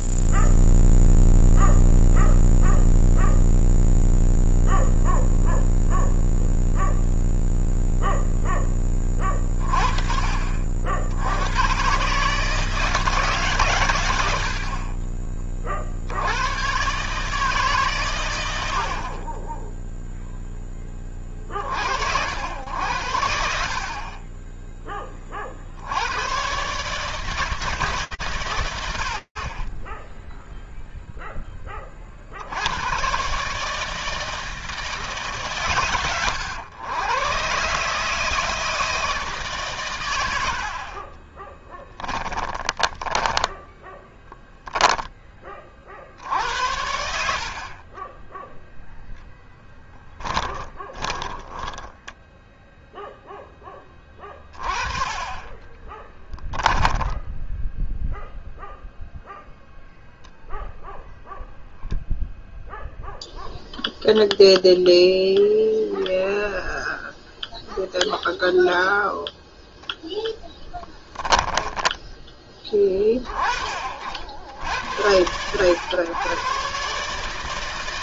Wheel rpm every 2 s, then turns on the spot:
0, 0, 0, 0, 0, 30, 120, 110, 60, 110, 0, 80, 20, 120, 100, 0, 100, 150, 110, 160, 40, 10, 10, 90, 10, 20, 0, 30, 20, 0, 0, 0, 0, 0, 0, 0, 20, 70, 120.
40-44 48-52 56-58